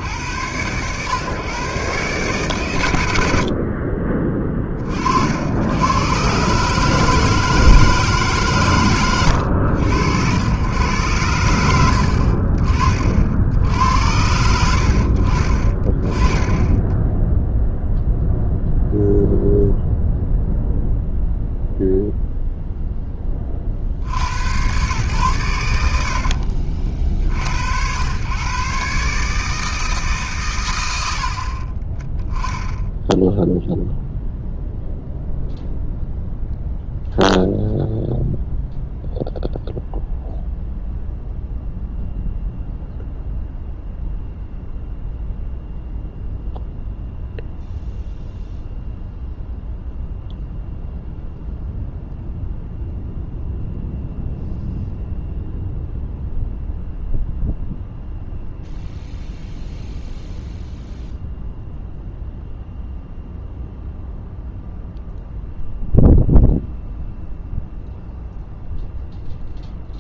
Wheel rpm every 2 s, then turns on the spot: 100, 130, 30, 150, 130, 100, 50, 70, 10, 0, 0, 0, 100, 60, 130, 130, 10, 0, 0, 0, 0, 0, 0, 0, 0, 0, 0, 0, 0, 0, 0, 0, 0, 0, 0.
none